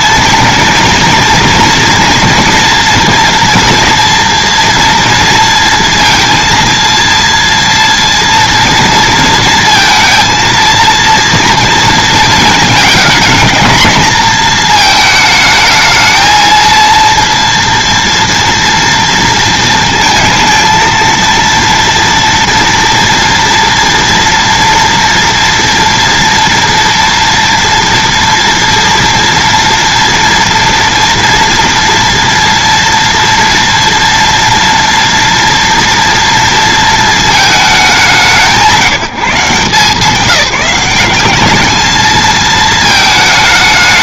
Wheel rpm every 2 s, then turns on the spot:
240, 240, 240, 230, 230, 230, 220, 220, 230, 230, 220, 230, 240, 230, 230, 230, 240, 230, 230, 150, 190, 220.
none